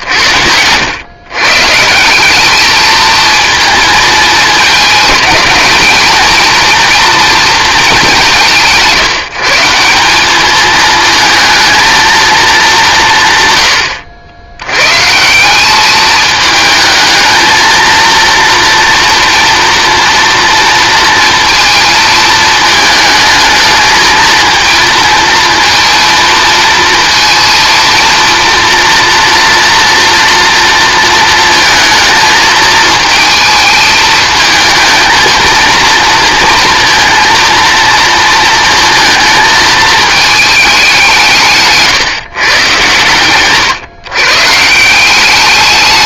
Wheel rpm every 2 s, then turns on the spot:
100, 220, 220, 230, 180, 210, 200, 110, 220, 240, 230, 220, 230, 230, 230, 230, 220, 220, 230, 230, 200, 120, 150.
none